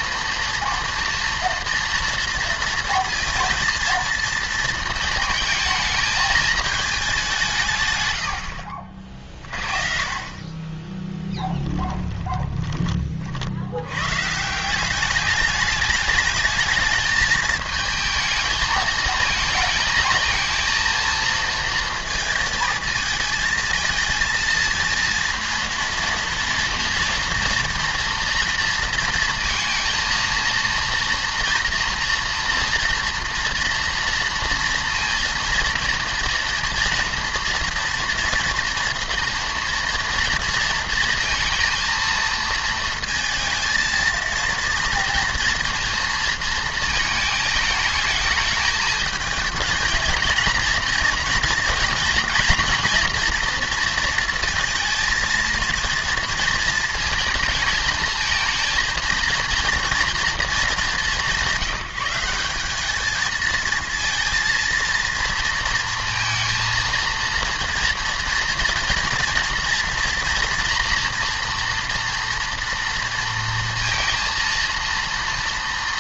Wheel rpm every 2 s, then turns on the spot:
230, 230, 230, 210, 70, 20, 20, 180, 220, 220, 230, 220, 230, 230, 230, 230, 230, 230, 230, 230, 230, 220, 230, 230, 220, 230, 230, 230, 230, 220, 210, 200, 230, 230, 230, 230, 230, 230.
8-10 12-14